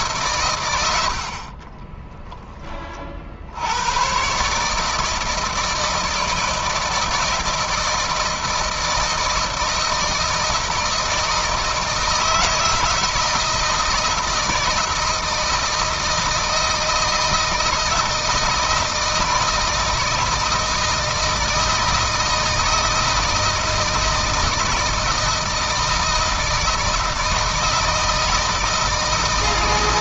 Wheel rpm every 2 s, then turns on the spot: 110, 20, 140, 160, 160, 160, 160, 160, 160, 160, 160, 160, 160, 160, 160.
none